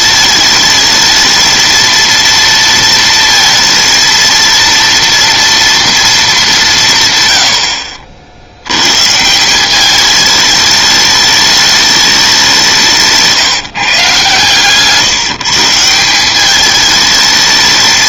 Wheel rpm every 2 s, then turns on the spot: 220, 230, 230, 180, 90, 210, 190, 150, 210.
none